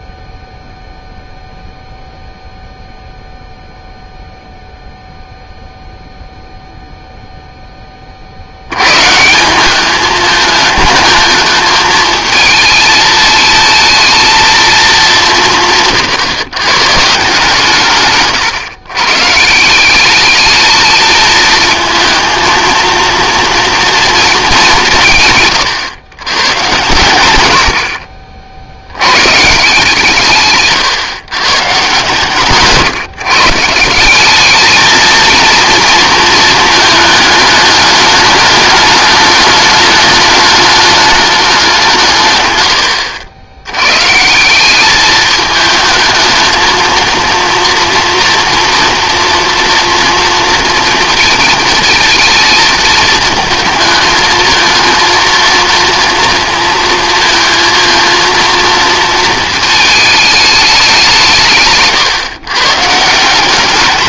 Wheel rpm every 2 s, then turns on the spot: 0, 0, 0, 10, 190, 220, 220, 160, 140, 170, 220, 230, 130, 80, 160, 140, 150, 230, 210, 210, 190, 90, 210, 230, 230, 220, 220, 230, 230, 220, 150, 160.
60-62